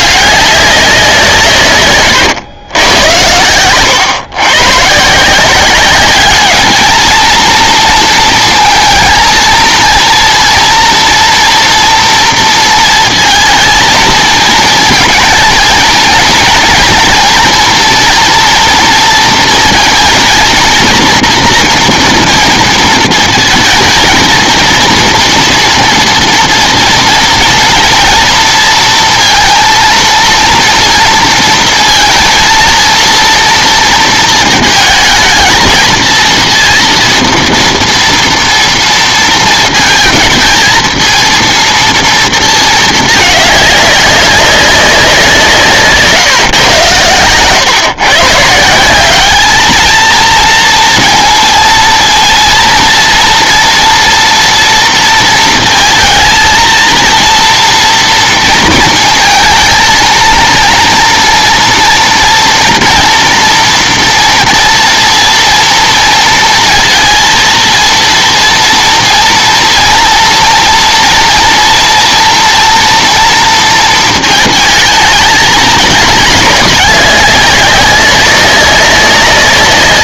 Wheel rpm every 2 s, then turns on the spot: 200, 110, 130, 210, 220, 230, 230, 230, 220, 240, 230, 230, 220, 230, 230, 230, 230, 230, 230, 230, 220, 230, 200, 130, 160, 230, 230, 230, 230, 230, 230, 230, 230, 230, 230, 230, 230, 220, 210, 200.
none